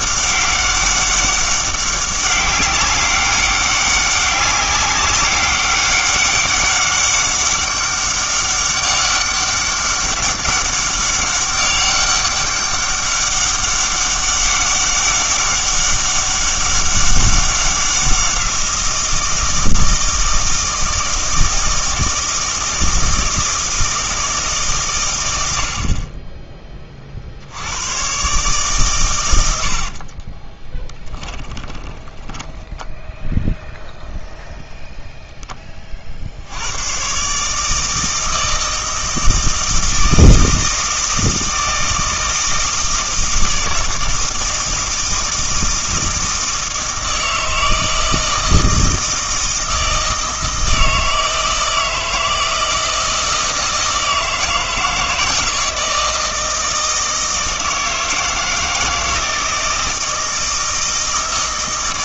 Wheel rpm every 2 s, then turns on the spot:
200, 200, 200, 200, 200, 200, 200, 200, 200, 180, 160, 160, 140, 20, 140, 20, 10, 0, 90, 160, 160, 160, 160, 160, 160, 160, 160, 160, 160, 160, 160.
30-34